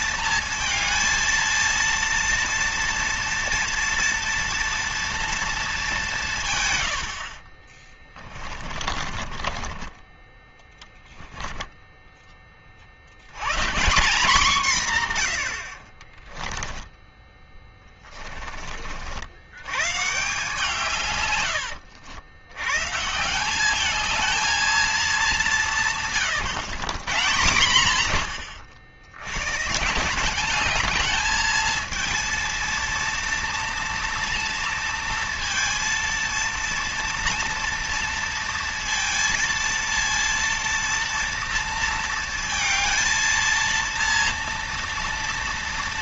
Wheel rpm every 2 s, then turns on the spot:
230, 230, 230, 80, 30, 10, 70, 150, 10, 50, 130, 140, 210, 140, 80, 210, 230, 230, 230, 230, 230, 230, 230.
6-12 16-18